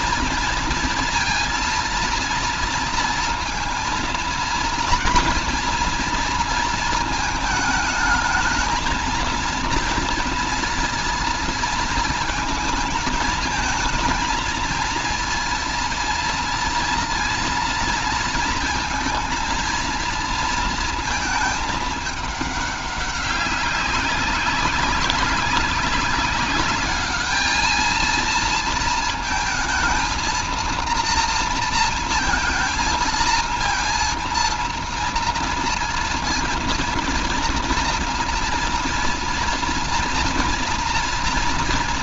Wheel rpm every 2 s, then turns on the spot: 230, 230, 230, 230, 220, 230, 220, 230, 230, 230, 230, 210, 190, 200, 230, 230, 230, 230, 230, 230, 230.
none